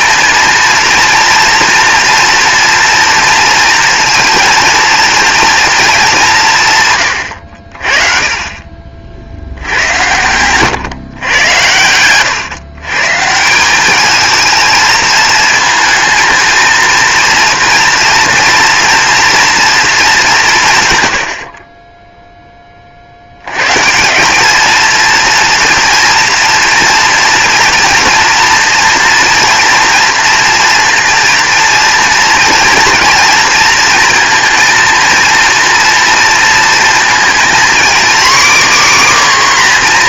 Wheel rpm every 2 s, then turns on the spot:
230, 230, 230, 140, 50, 130, 140, 220, 230, 230, 130, 40, 220, 230, 230, 240, 230, 230, 230, 280.
none